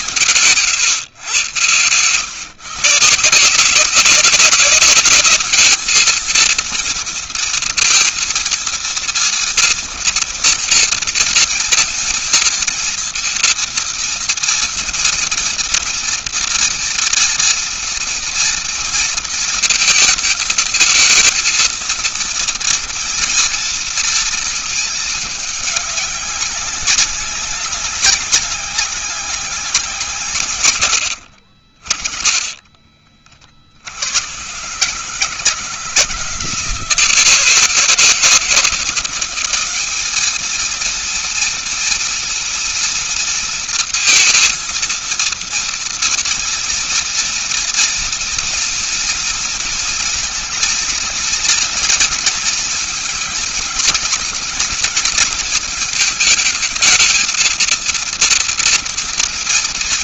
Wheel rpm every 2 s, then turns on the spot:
130, 140, 200, 230, 230, 230, 230, 230, 230, 230, 220, 230, 220, 190, 190, 120, 40, 120, 170, 170, 220, 230, 230, 230, 230, 220, 230, 230, 220, 230.
32-34